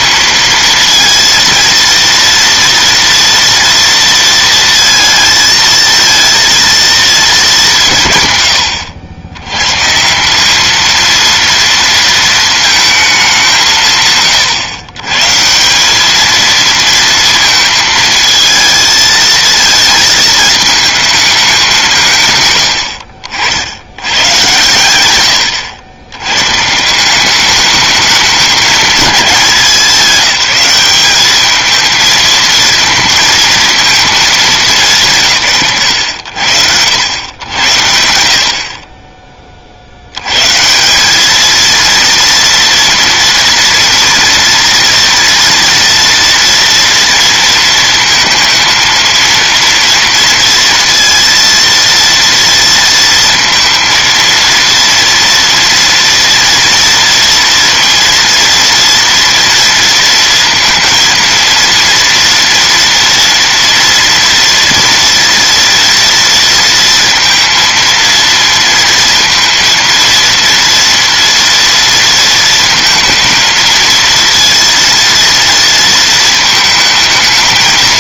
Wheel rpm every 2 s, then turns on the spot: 220, 230, 230, 230, 110, 210, 230, 120, 230, 220, 220, 110, 110, 150, 210, 190, 220, 160, 80, 50, 140, 230, 230, 230, 230, 230, 230, 230, 230, 230, 230, 230, 230, 230, 230, 230, 230, 230, 220.
none